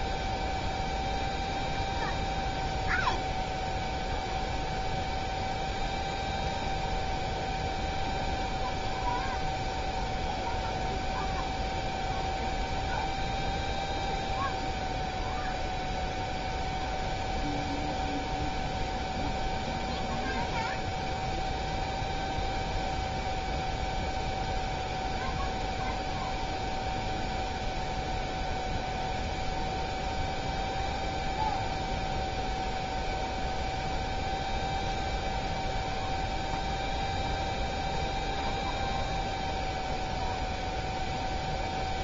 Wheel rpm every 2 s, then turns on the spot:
0, 0, 0, 0, 0, 0, 0, 0, 0, 0, 0, 0, 0, 0, 0, 0, 0, 0, 0, 0, 0.
none